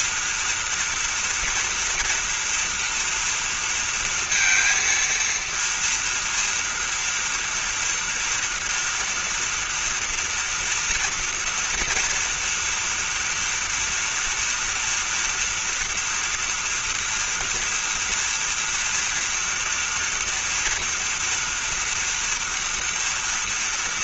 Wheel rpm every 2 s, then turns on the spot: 230, 230, 230, 230, 230, 240, 230, 230, 230, 230, 240, 230.
none